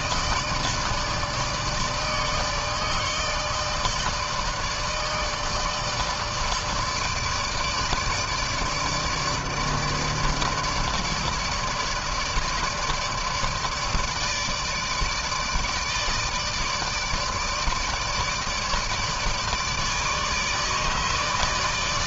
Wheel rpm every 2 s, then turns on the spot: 160, 150, 160, 160, 150, 150, 150, 150, 160, 160, 160.
none